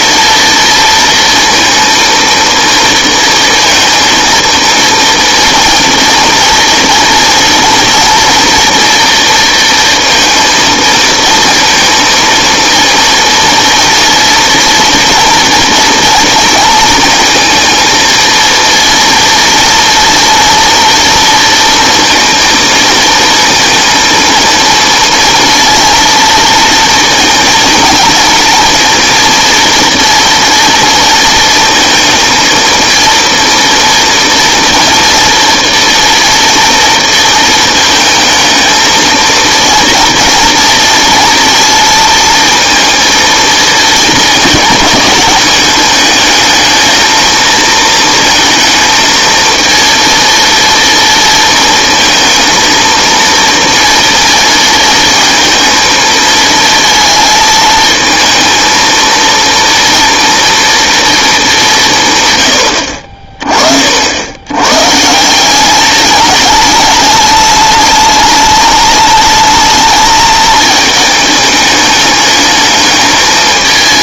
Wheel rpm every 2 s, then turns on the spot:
230, 230, 230, 230, 230, 230, 230, 230, 230, 230, 230, 220, 230, 230, 230, 230, 230, 230, 230, 230, 230, 230, 220, 220, 230, 230, 230, 230, 220, 230, 220, 40, 160, 210, 210, 220, 220.
none